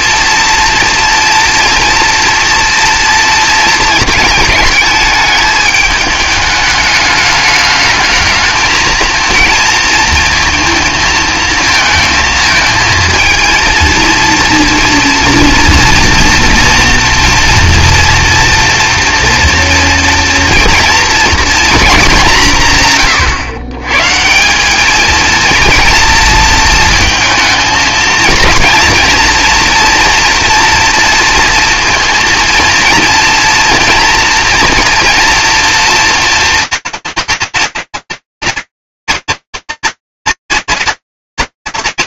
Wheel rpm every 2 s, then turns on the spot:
230, 230, 220, 210, 220, 230, 220, 230, 230, 240, 240, 160, 190, 230, 220, 230, 230, 230, 240, 230, 240.
none